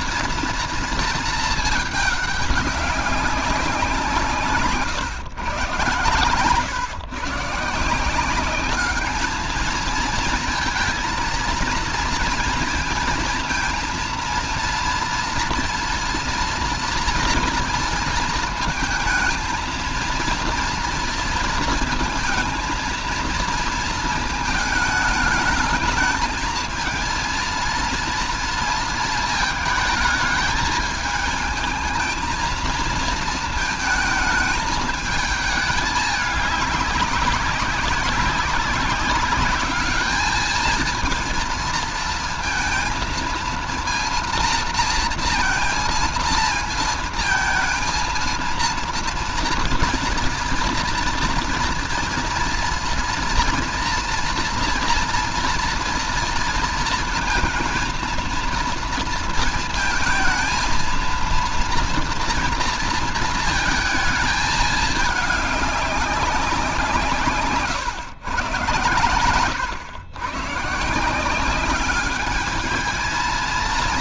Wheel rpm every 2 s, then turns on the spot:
230, 210, 140, 130, 200, 230, 230, 230, 240, 230, 240, 230, 220, 220, 230, 210, 230, 220, 210, 200, 220, 220, 230, 230, 230, 230, 230, 230, 230, 230, 230, 230, 220, 180, 120, 130, 210.
none